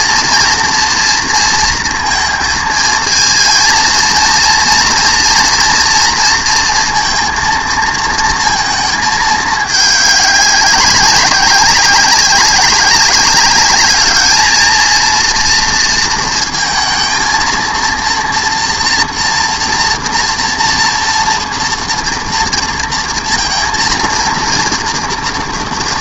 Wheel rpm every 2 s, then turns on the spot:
230, 220, 230, 230, 220, 200, 200, 220, 230, 240, 230, 230, 230.
none